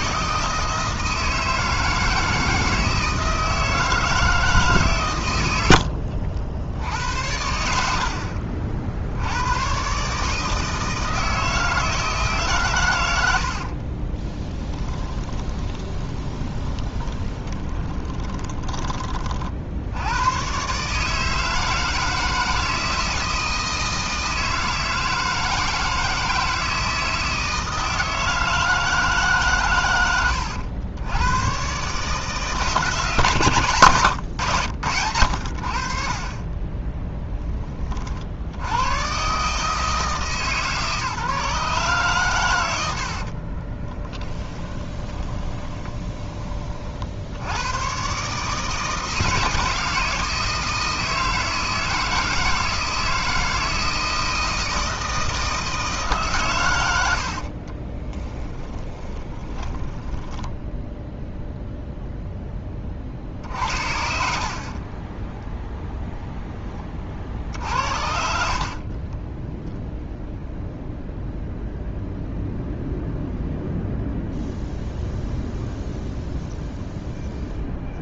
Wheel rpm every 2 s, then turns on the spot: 160, 160, 140, 70, 50, 160, 110, 10, 20, 20, 130, 160, 160, 160, 160, 100, 160, 90, 10, 100, 150, 100, 20, 40, 160, 160, 160, 160, 100, 10, 0, 20, 30, 20, 50, 0, 0, 0, 0.
14-18 36-38 44-46 58-60 64-66 68-70